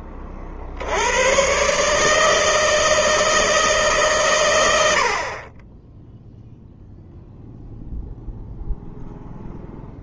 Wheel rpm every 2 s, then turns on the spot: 70, 160, 70, 0, 0.
none